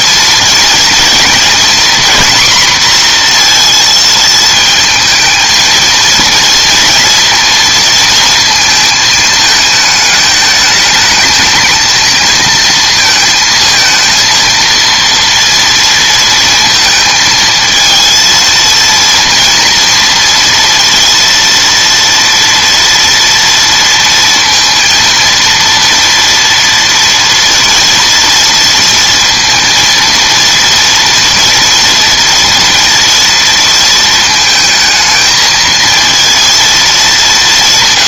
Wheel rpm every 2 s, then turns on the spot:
230, 240, 220, 230, 220, 220, 230, 230, 230, 230, 230, 230, 230, 230, 230, 230, 230, 220, 230.
none